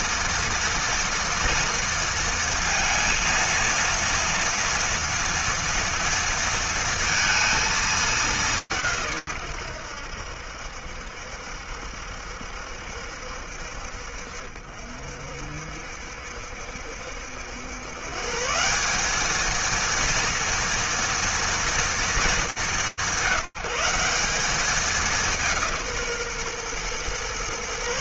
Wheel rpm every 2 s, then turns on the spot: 230, 230, 240, 230, 120, 70, 60, 60, 110, 230, 230, 190, 170, 140.
none